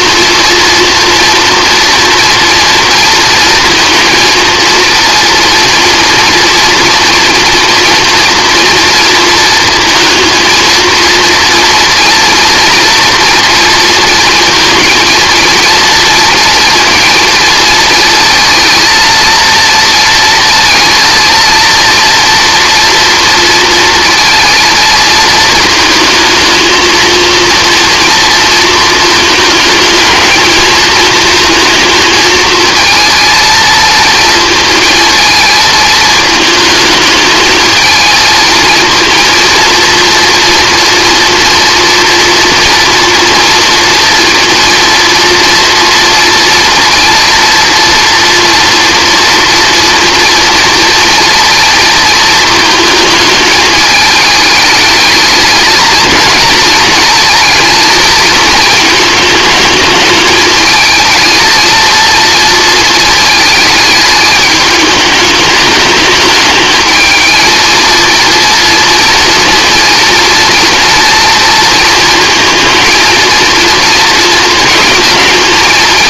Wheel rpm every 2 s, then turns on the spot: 240, 230, 230, 230, 230, 230, 240, 230, 230, 230, 230, 230, 220, 230, 220, 220, 230, 220, 220, 230, 230, 230, 230, 230, 230, 230, 220, 220, 230, 220, 220, 220, 210, 220, 230, 230, 230, 230.
none